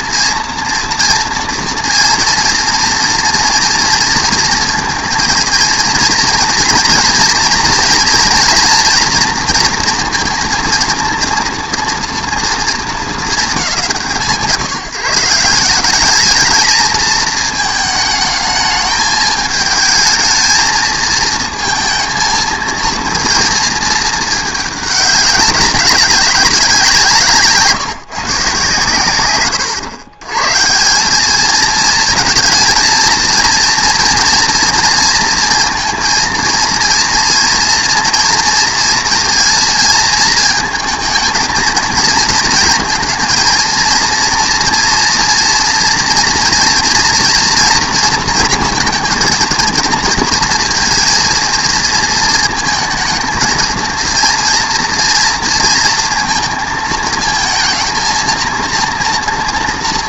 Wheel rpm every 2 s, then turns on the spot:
230, 230, 230, 230, 230, 230, 230, 150, 210, 220, 230, 230, 210, 190, 140, 140, 220, 230, 230, 230, 220, 230, 230, 230, 230, 230, 230, 230, 230, 230.
none